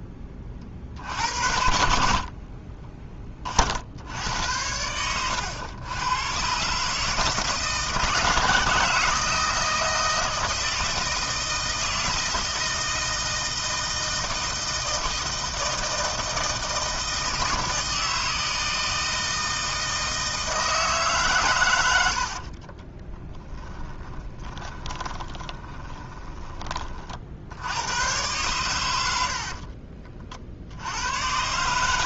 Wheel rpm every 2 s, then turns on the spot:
40, 20, 90, 140, 160, 160, 160, 160, 160, 160, 160, 30, 20, 30, 110, 80.
22-26